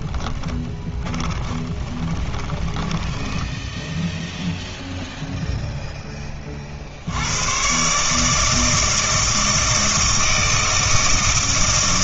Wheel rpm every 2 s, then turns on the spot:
20, 20, 0, 40, 160, 160.
0-4